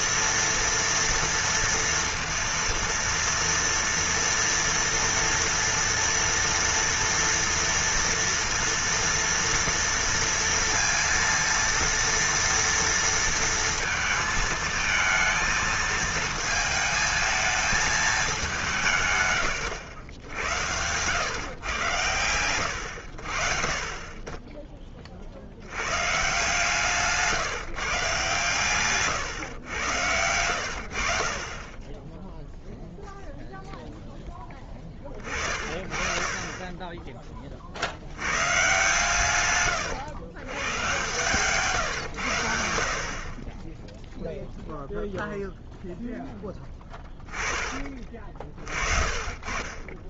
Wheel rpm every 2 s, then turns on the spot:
230, 230, 240, 230, 230, 230, 230, 220, 220, 180, 90, 90, 20, 140, 130, 80, 0, 10, 20, 120, 110, 80, 0, 10, 40.
46-50